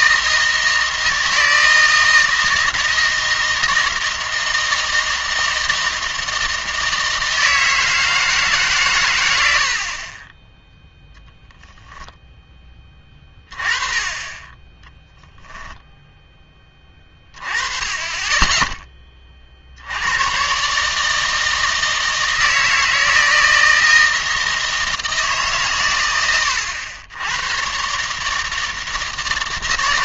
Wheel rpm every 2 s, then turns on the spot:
160, 160, 160, 160, 140, 10, 10, 20, 10, 20, 130, 160, 160, 100, 160.
none